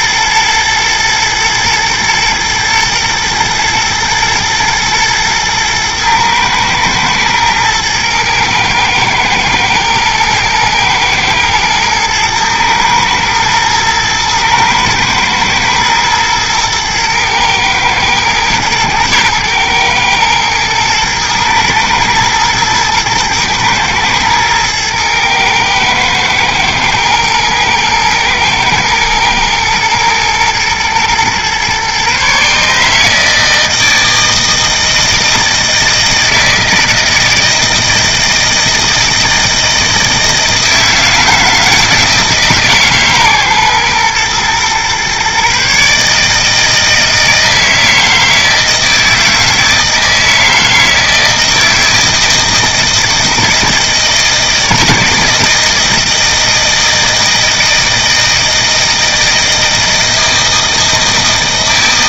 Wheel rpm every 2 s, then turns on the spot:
110, 110, 110, 110, 110, 110, 110, 110, 110, 110, 110, 110, 110, 110, 110, 120, 140, 160, 160, 160, 160, 150, 120, 160, 160, 160, 160, 160, 160, 160, 160.
none